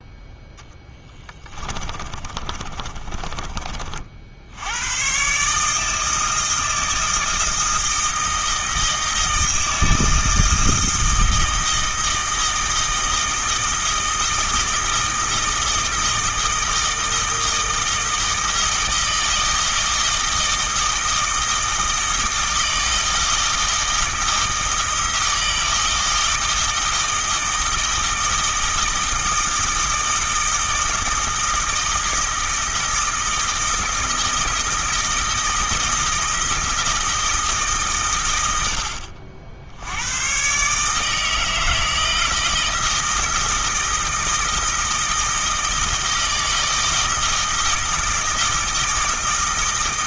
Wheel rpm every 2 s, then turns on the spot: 10, 30, 110, 160, 160, 160, 160, 160, 160, 160, 160, 160, 160, 160, 160, 160, 160, 160, 160, 70, 150, 160, 160, 160, 160.
0-4